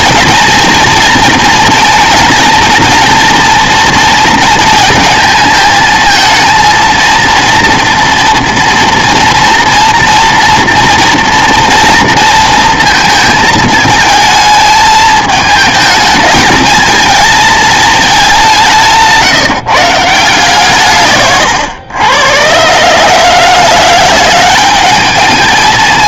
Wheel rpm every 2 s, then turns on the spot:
220, 220, 220, 220, 230, 230, 230, 220, 220, 180, 150, 130, 200.
none